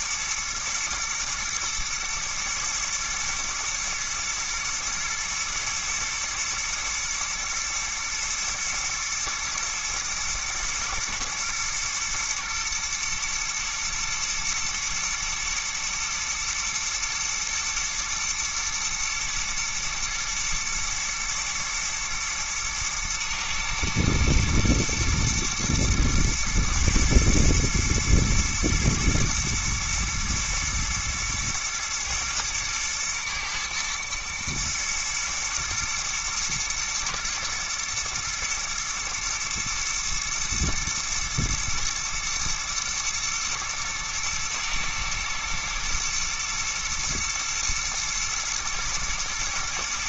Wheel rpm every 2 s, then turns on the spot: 110, 120, 110, 110, 110, 110, 120, 120, 120, 110, 110, 110, 120, 120, 120, 110, 110, 110, 110, 120, 110, 110, 110, 120, 120.
none